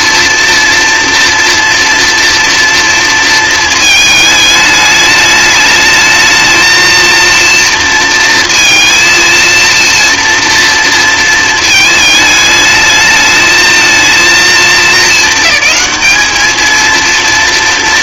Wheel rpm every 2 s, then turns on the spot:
230, 230, 210, 220, 230, 230, 210, 220, 220.
none